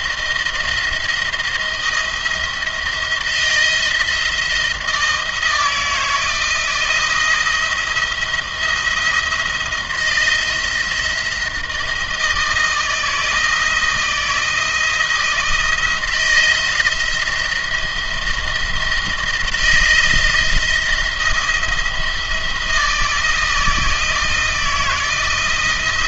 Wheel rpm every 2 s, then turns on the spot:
160, 170, 170, 160, 170, 170, 160, 160, 170, 170, 170, 170, 170.
none